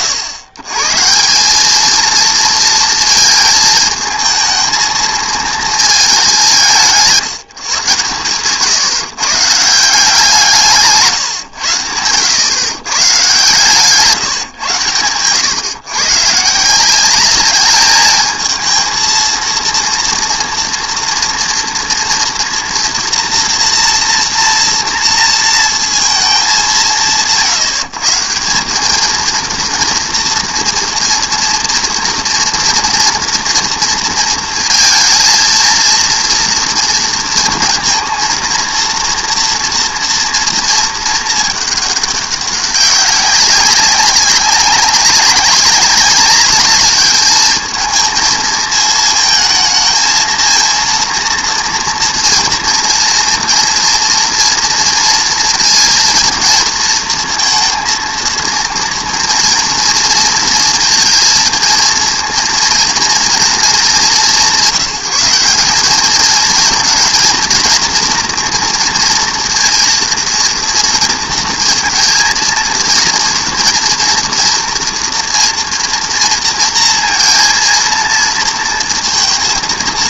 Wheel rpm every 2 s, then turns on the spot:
140, 230, 230, 170, 130, 160, 130, 130, 170, 220, 230, 230, 230, 160, 200, 230, 230, 230, 230, 230, 230, 190, 200, 210, 220, 230, 230, 230, 230, 230, 230, 220, 180, 230, 230, 230, 230, 230, 230, 230.
none